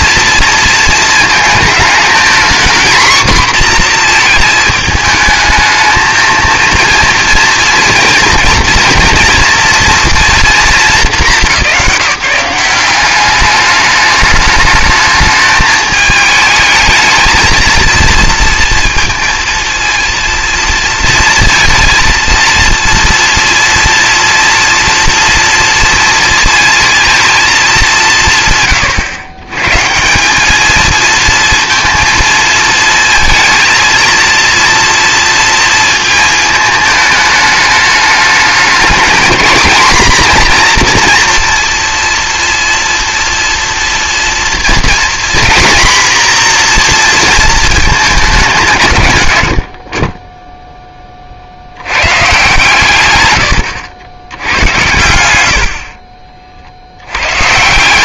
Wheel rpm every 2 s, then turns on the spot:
230, 230, 220, 230, 230, 220, 180, 210, 220, 230, 230, 230, 230, 230, 110, 200, 230, 230, 220, 220, 250, 230, 230, 240, 170, 10, 140, 100, 50.
none